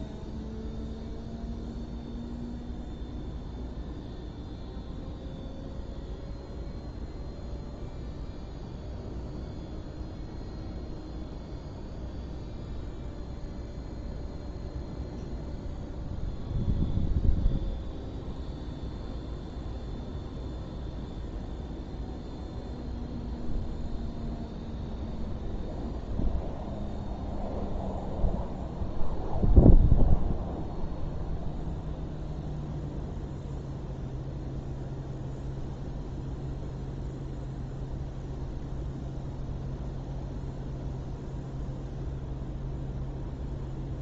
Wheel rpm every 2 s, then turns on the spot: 0, 0, 0, 0, 0, 0, 0, 0, 0, 0, 0, 0, 0, 0, 0, 0, 0, 0, 0, 0, 0, 0.
none